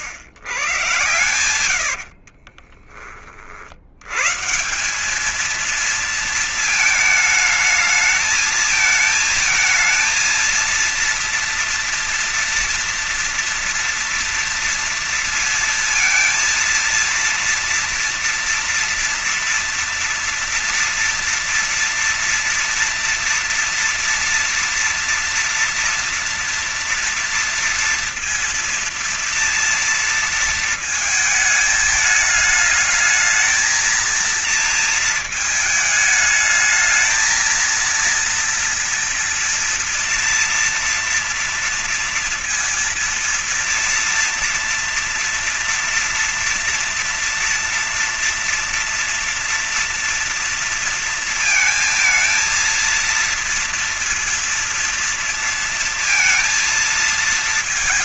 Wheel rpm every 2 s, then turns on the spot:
120, 50, 130, 220, 220, 230, 230, 230, 230, 230, 230, 230, 230, 230, 230, 230, 220, 230, 220, 230, 230, 230, 230, 230, 240, 230, 230, 230, 230.
2-4